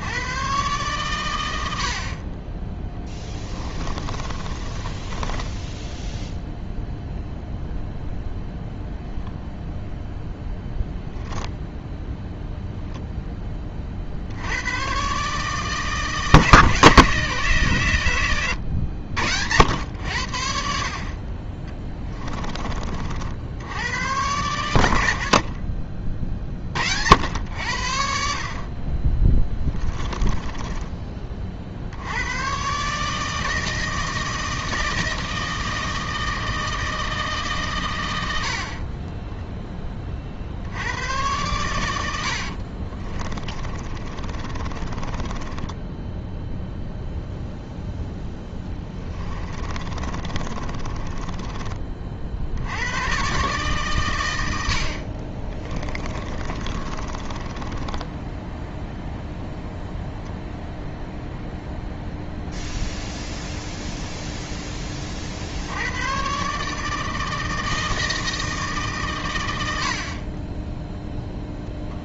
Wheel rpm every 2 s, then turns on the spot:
120, 10, 20, 0, 0, 0, 0, 100, 150, 100, 60, 40, 100, 60, 40, 10, 130, 160, 160, 50, 90, 40, 30, 0, 20, 30, 90, 70, 30, 0, 0, 0, 20, 150, 150, 10.
4-6 30-32 42-46 48-52 56-58